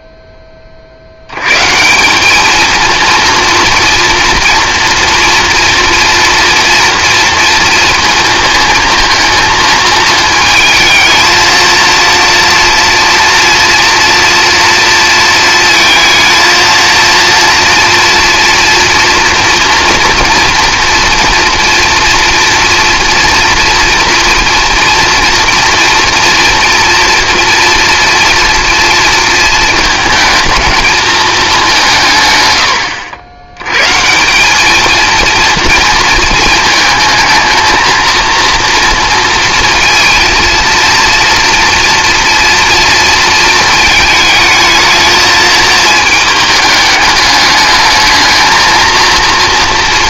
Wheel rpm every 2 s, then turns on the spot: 50, 220, 230, 230, 220, 220, 230, 240, 230, 230, 240, 230, 230, 230, 230, 220, 100, 220, 220, 230, 230, 230, 220, 210, 230.
none